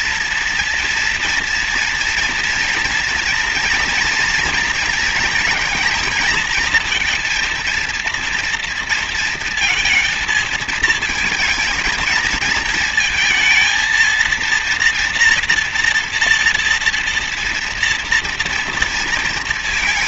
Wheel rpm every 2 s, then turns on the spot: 230, 230, 230, 230, 230, 230, 220, 230, 230, 230.
none